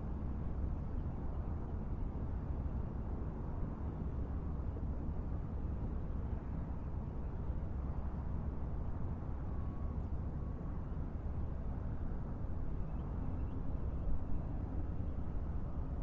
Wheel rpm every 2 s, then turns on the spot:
0, 0, 0, 0, 0, 0, 0, 0.
none